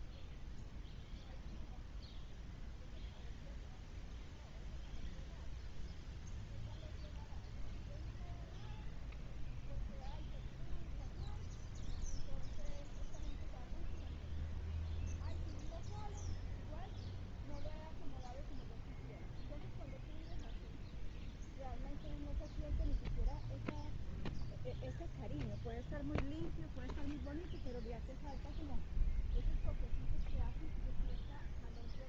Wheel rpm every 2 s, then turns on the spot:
0, 0, 0, 0, 0, 0, 0, 0, 0, 0, 0, 0, 0, 0, 0, 0.
none